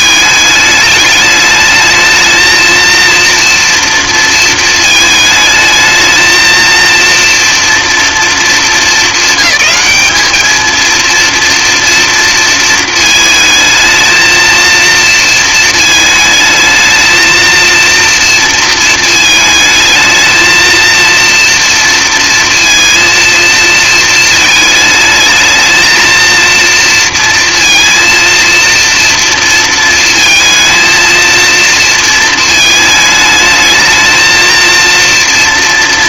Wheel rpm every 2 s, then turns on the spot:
210, 230, 220, 230, 220, 220, 220, 230, 220, 230, 230, 230, 220, 230, 230, 230, 220, 230.
none